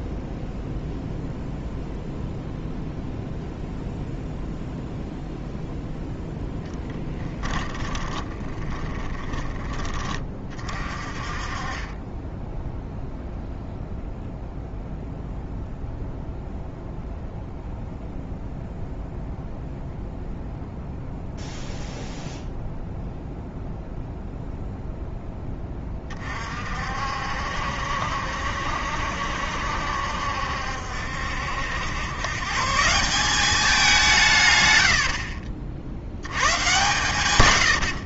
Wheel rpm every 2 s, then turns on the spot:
0, 0, 0, 10, 20, 30, 0, 0, 0, 0, 0, 0, 0, 50, 70, 70, 160, 100, 110.
6-10